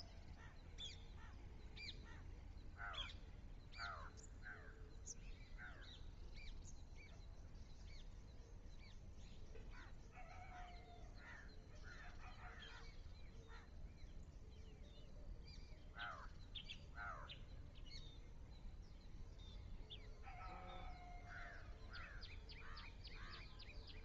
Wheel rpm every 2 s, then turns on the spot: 0, 0, 0, 0, 0, 0, 0, 0, 0, 0, 0, 0.
none